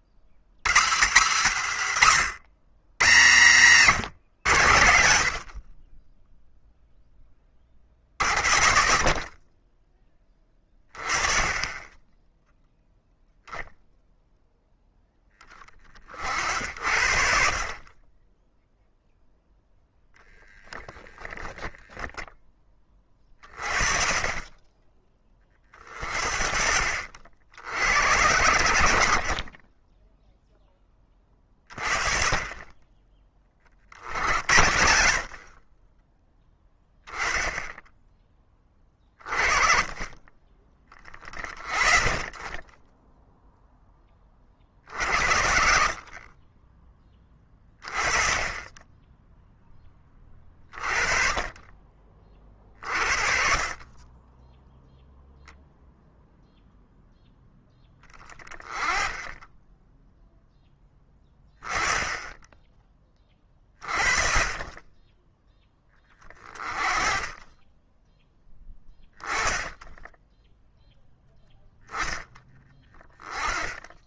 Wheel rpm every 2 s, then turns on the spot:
100, 110, 80, 0, 50, 20, 0, 0, 80, 0, 10, 20, 20, 60, 90, 10, 20, 60, 10, 20, 20, 10, 50, 20, 10, 30, 50, 0, 0, 30, 10, 20, 20, 30, 10, 0, 10.
20-22 36-38